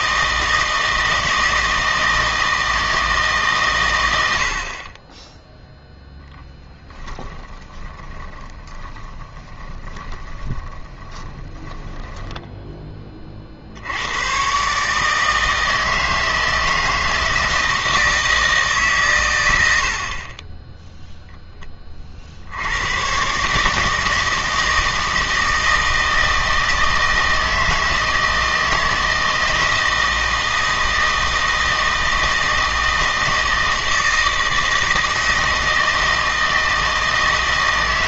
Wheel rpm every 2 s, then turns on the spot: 160, 160, 40, 10, 10, 20, 10, 140, 160, 140, 0, 90, 160, 160, 160, 160, 160, 160, 160.
6-12